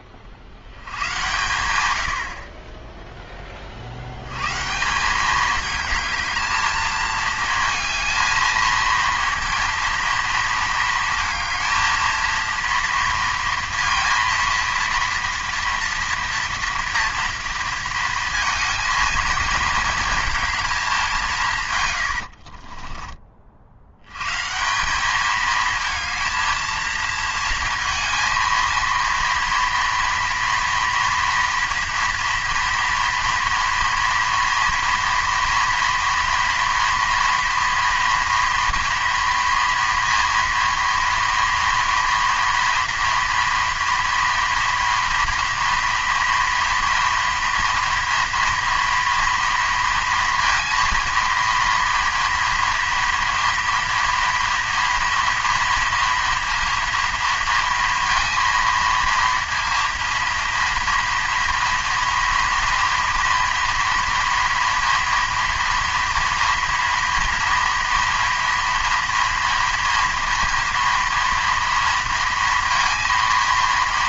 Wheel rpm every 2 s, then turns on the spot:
90, 30, 140, 220, 220, 230, 230, 230, 230, 230, 220, 40, 170, 230, 230, 230, 230, 230, 230, 230, 230, 240, 240, 230, 230, 230, 230, 230, 230, 230, 230, 240, 230, 230, 230, 230, 230.
22-24